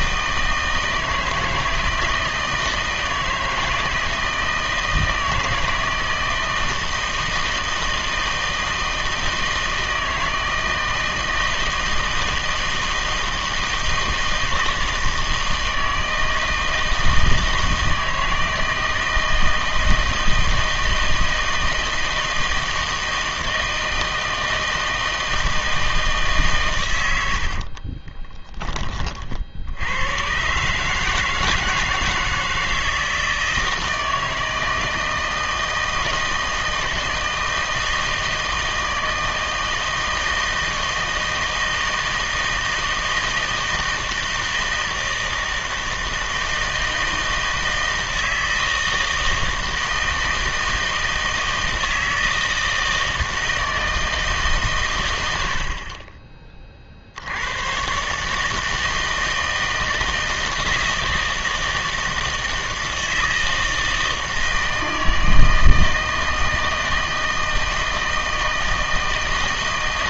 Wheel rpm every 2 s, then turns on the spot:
160, 160, 160, 160, 170, 160, 160, 160, 160, 160, 160, 160, 160, 140, 20, 140, 160, 160, 160, 160, 160, 160, 160, 160, 160, 160, 160, 140, 30, 160, 160, 160, 160, 160, 160.
none